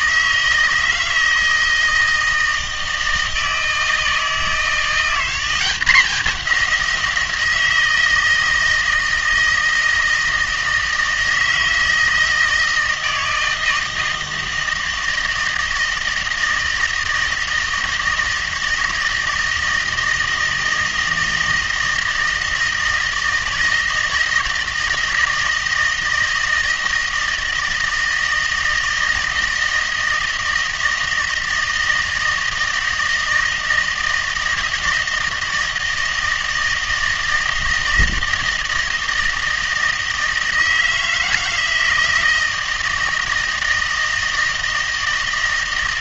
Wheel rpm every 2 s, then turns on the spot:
160, 160, 170, 190, 160, 160, 160, 160, 160, 160, 160, 160, 160, 160, 160, 160, 160, 160, 160, 160, 160, 160, 160.
none